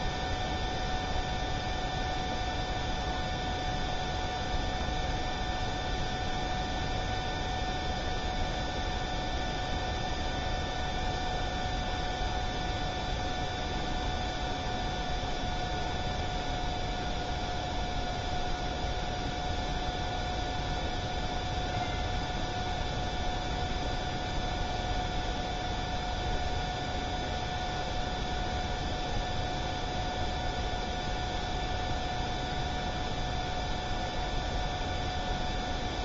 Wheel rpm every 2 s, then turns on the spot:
0, 0, 0, 0, 0, 0, 0, 0, 0, 0, 0, 0, 0, 0, 0, 0, 0, 0.
none